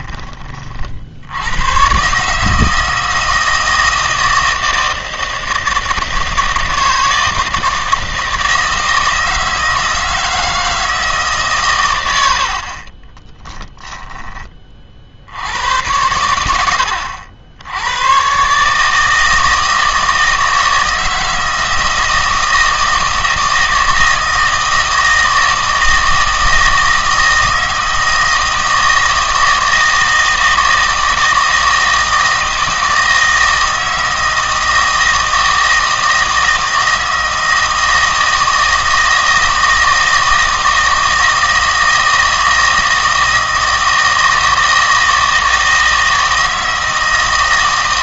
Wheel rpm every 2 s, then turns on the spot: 40, 160, 160, 160, 160, 160, 50, 30, 90, 150, 160, 160, 160, 160, 160, 160, 160, 160, 160, 160, 160, 160, 160, 160.
none